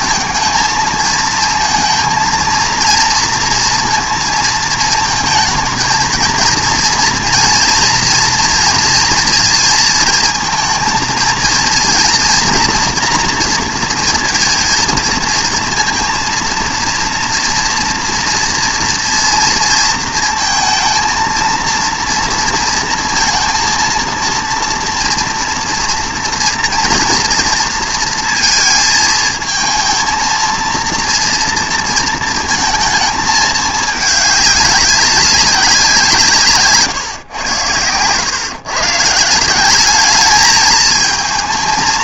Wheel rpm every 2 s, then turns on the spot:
230, 230, 220, 230, 230, 230, 240, 230, 230, 230, 230, 230, 230, 230, 220, 230, 230, 200, 140, 140, 220.
36-38